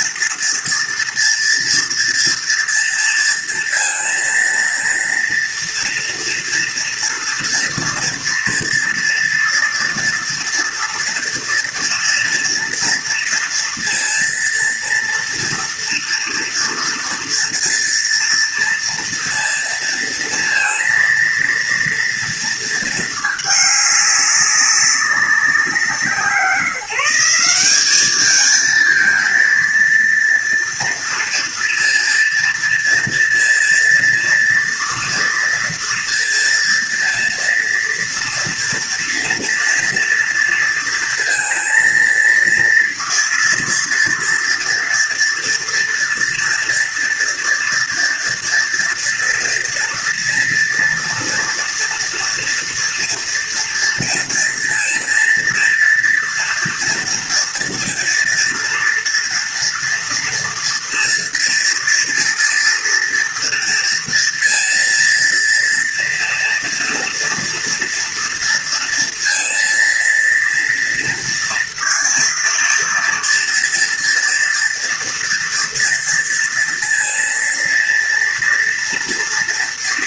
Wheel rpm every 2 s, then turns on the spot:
230, 230, 230, 230, 230, 230, 230, 230, 240, 230, 230, 230, 200, 160, 220, 230, 230, 230, 230, 230, 230, 230, 230, 230, 240, 230, 230, 230, 230, 230, 230, 230, 230, 230, 230, 230, 230, 230, 230, 230.
none